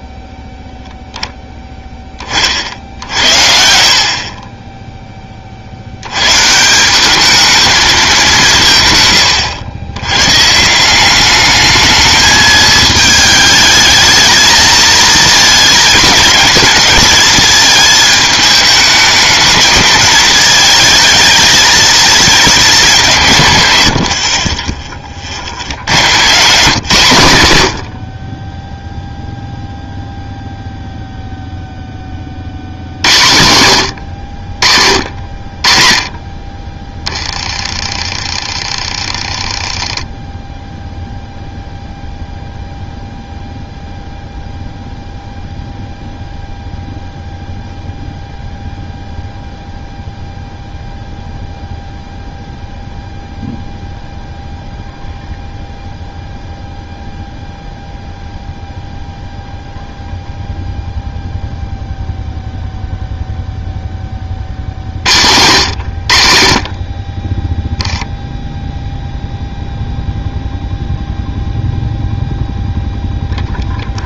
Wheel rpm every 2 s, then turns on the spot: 0, 60, 20, 160, 160, 150, 220, 220, 220, 210, 220, 210, 30, 150, 10, 0, 70, 60, 20, 30, 0, 0, 0, 0, 0, 0, 0, 0, 0, 0, 0, 0, 50, 40, 0, 0, 0.
none